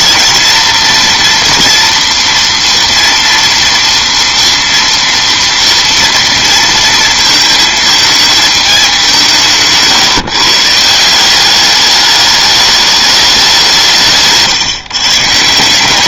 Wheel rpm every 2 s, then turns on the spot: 230, 230, 230, 230, 200, 150, 210, 150.
none